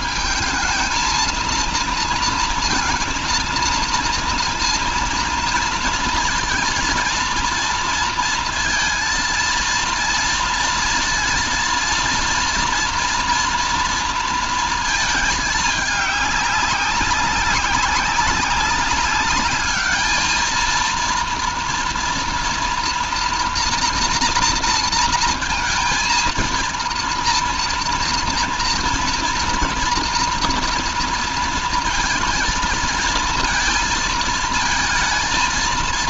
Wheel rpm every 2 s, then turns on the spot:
220, 230, 230, 230, 230, 230, 230, 230, 200, 200, 220, 240, 240, 230, 230, 230, 220, 220.
none